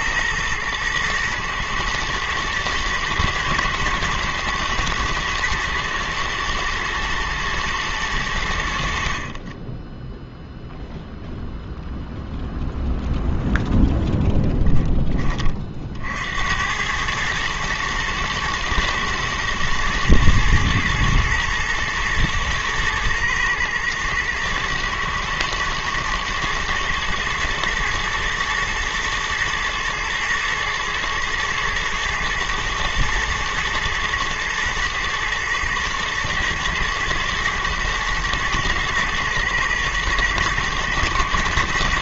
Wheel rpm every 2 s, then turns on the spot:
110, 110, 110, 120, 70, 0, 0, 10, 100, 110, 110, 120, 110, 110, 110, 110, 120, 110, 110, 120, 120.
none